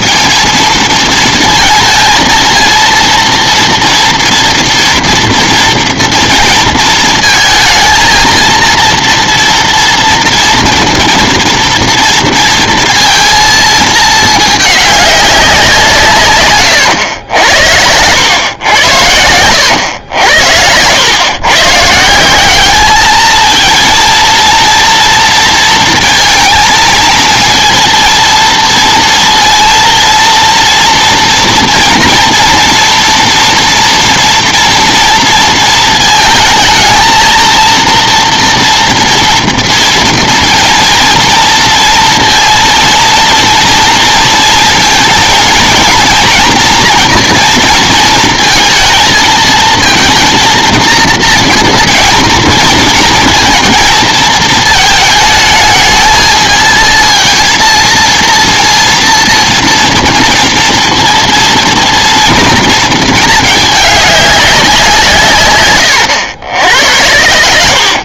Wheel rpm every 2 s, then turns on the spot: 230, 230, 230, 230, 230, 240, 230, 210, 120, 100, 90, 210, 230, 220, 230, 230, 230, 230, 220, 230, 230, 230, 230, 230, 230, 230, 230, 220, 220, 230, 230, 230, 180, 90.
16-18